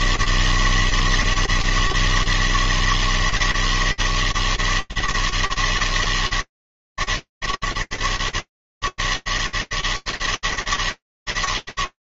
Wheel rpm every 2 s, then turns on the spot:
140, 160, 160, 160, 150, 160.
none